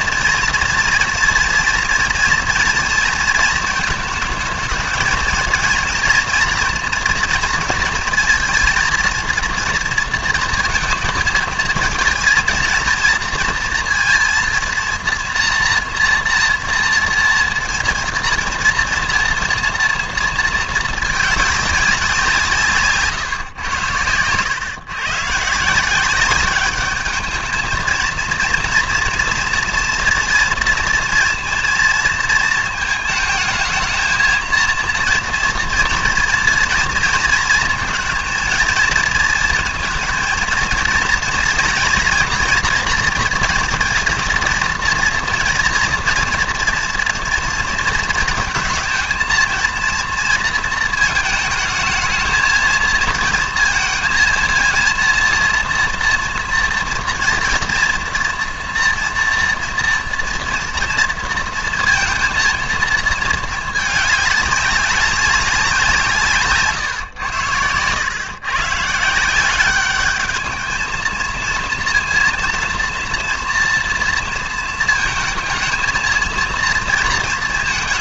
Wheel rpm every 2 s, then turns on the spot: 230, 230, 220, 230, 230, 230, 230, 230, 230, 230, 230, 170, 120, 200, 230, 240, 220, 230, 230, 230, 230, 230, 230, 230, 230, 230, 220, 230, 230, 230, 230, 230, 200, 140, 120, 220, 230, 230, 230.
none